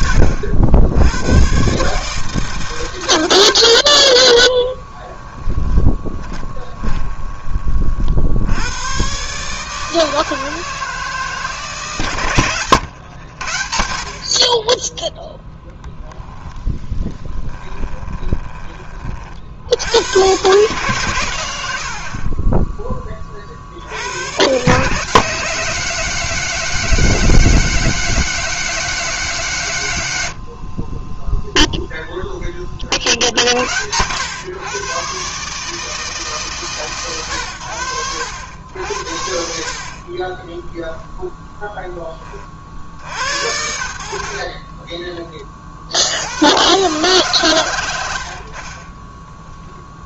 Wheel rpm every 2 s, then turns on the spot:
90, 100, 10, 20, 120, 160, 100, 10, 10, 40, 120, 20, 160, 190, 190, 20, 30, 130, 130, 80, 0, 80, 20, 130, 10.
4-8 16-18 48-50